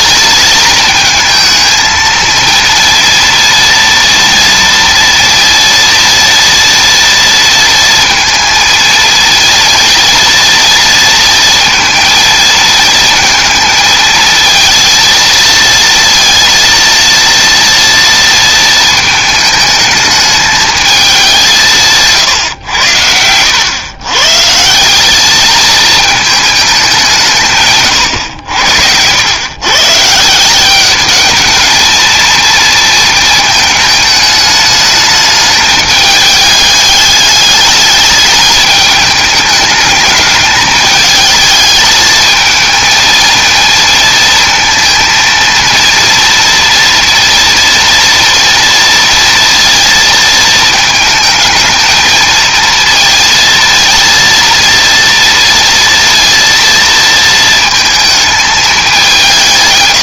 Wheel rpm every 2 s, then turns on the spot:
220, 230, 230, 230, 230, 230, 230, 230, 230, 220, 210, 100, 180, 200, 90, 200, 230, 220, 210, 210, 220, 220, 230, 230, 230, 220, 230, 230, 230, 200.
none